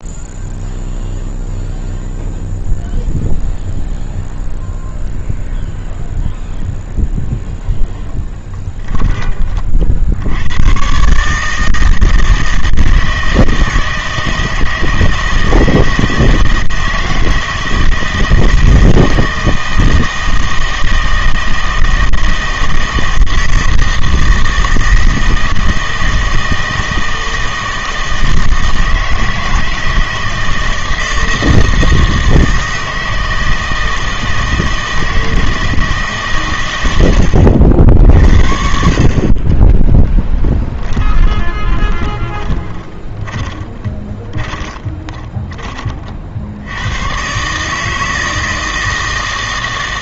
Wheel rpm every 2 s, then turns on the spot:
0, 0, 0, 0, 10, 100, 160, 160, 160, 160, 160, 160, 160, 160, 160, 160, 160, 160, 110, 70, 10, 20, 20, 80, 160.
40-46